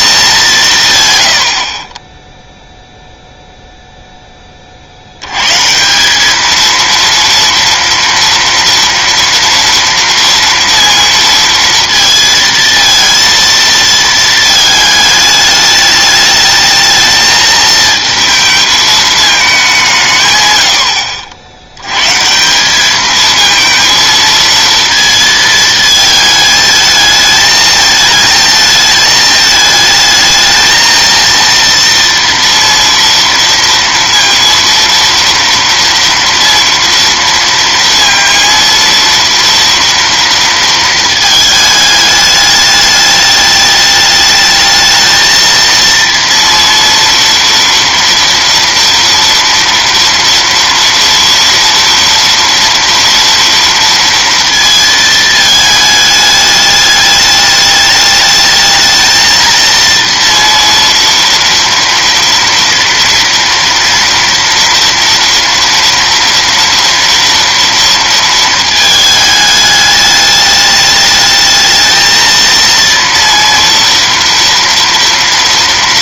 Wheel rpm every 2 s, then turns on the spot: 170, 0, 30, 220, 230, 230, 220, 220, 210, 220, 110, 170, 230, 220, 220, 220, 230, 230, 230, 230, 230, 210, 220, 230, 230, 230, 230, 230, 210, 220, 230, 230, 230, 230, 220, 210, 230, 230.
none